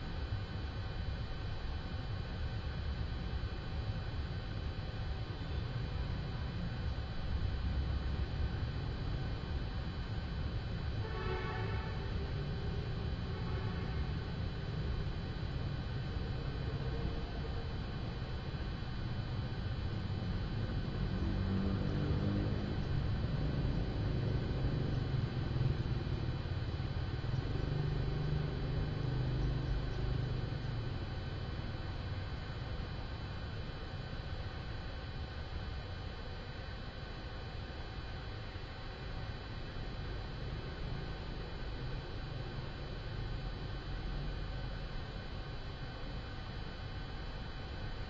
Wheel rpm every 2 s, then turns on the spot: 0, 0, 0, 0, 0, 0, 0, 0, 0, 0, 0, 0, 0, 0, 0, 0, 0, 0, 0, 0, 0, 0, 0, 0.
none